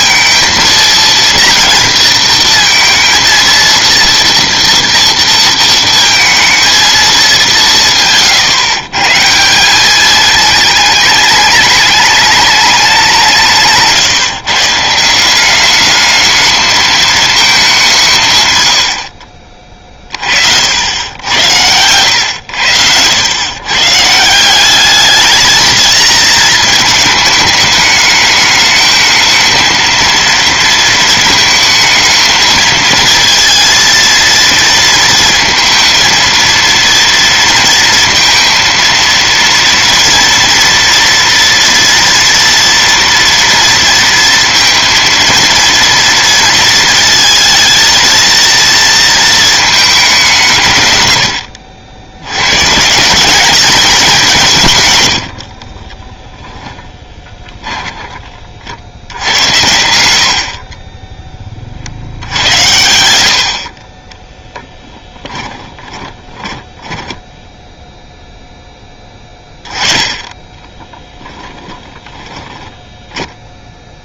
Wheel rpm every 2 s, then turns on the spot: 230, 230, 230, 220, 140, 210, 190, 160, 220, 90, 80, 80, 190, 220, 220, 230, 220, 230, 230, 230, 230, 230, 230, 220, 230, 130, 160, 130, 10, 40, 50, 90, 10, 20, 10, 10, 10.
56-58 64-68 70-74